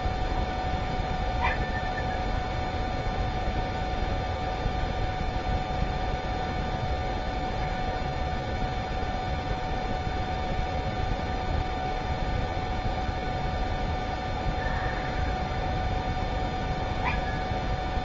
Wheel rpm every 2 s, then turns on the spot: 0, 0, 0, 0, 0, 0, 0, 0, 0.
none